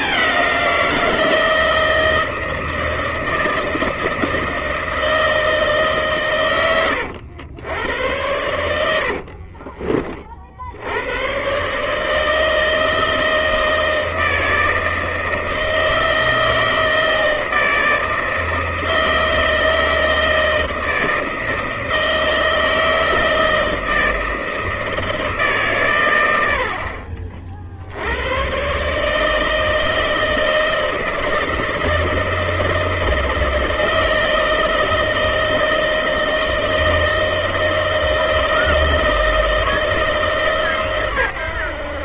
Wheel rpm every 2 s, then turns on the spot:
190, 160, 160, 120, 100, 60, 160, 160, 160, 160, 160, 160, 160, 80, 110, 160, 160, 160, 160, 160, 150.
8-10